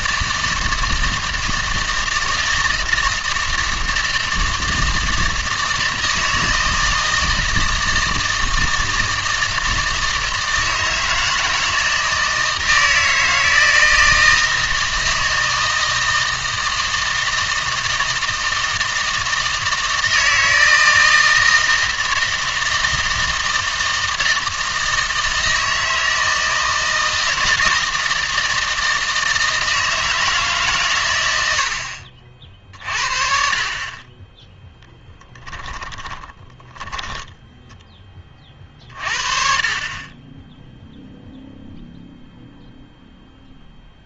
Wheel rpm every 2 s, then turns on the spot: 160, 160, 160, 160, 160, 160, 160, 160, 160, 160, 160, 160, 160, 160, 160, 140, 50, 10, 10, 40, 0, 0.
34-38